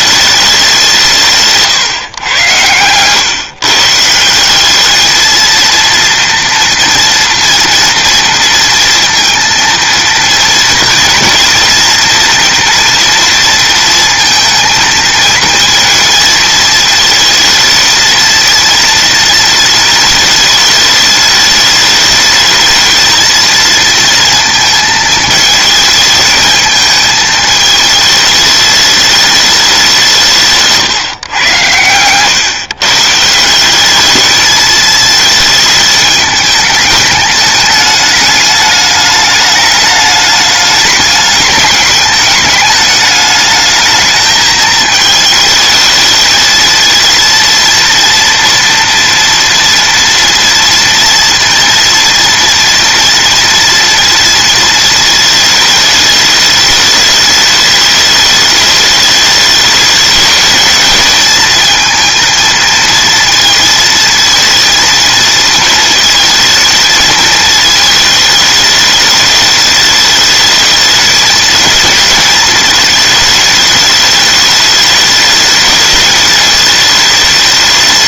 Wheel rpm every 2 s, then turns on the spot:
220, 140, 140, 230, 230, 230, 230, 230, 230, 220, 230, 210, 230, 220, 220, 200, 120, 170, 210, 210, 210, 200, 210, 220, 230, 230, 230, 230, 220, 210, 210, 220, 230, 230, 220, 210, 220, 210, 210.
none